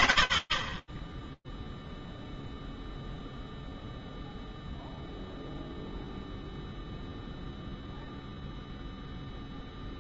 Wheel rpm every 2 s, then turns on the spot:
20, 0, 0, 0, 70.
none